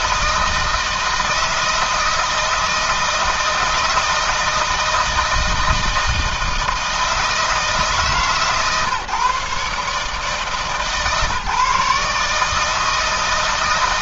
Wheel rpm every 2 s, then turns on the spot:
160, 160, 160, 160, 140, 150, 150.
none